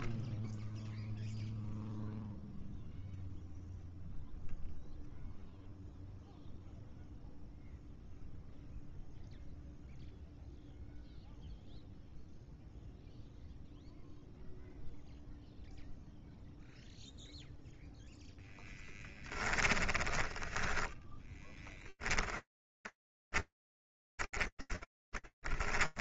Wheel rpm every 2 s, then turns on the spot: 0, 0, 0, 0, 0, 0, 0, 0, 10, 10, 20, 20, 10.
16-26